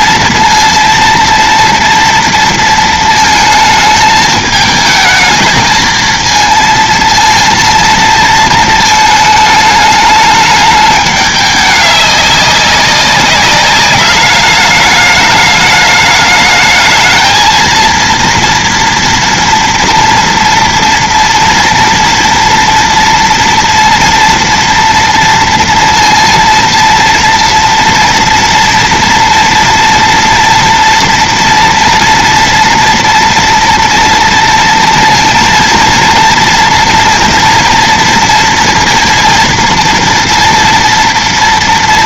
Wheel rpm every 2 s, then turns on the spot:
230, 230, 220, 230, 230, 210, 200, 210, 210, 230, 230, 230, 230, 230, 230, 230, 230, 230, 230, 230, 240.
none